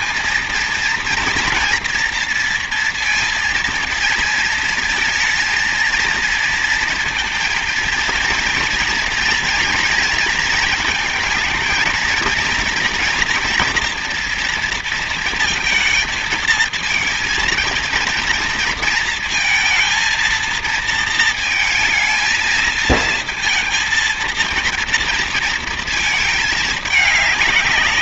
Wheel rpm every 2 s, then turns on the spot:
230, 230, 220, 230, 230, 230, 230, 230, 230, 230, 230, 220, 230, 220.
none